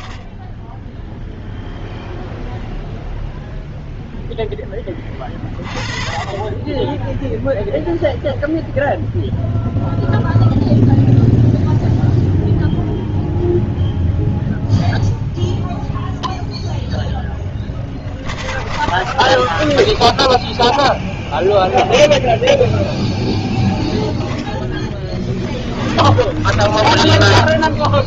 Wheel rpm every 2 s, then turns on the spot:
10, 0, 10, 10, 0, 0, 0, 0, 0, 10, 0, 0, 10, 10.
none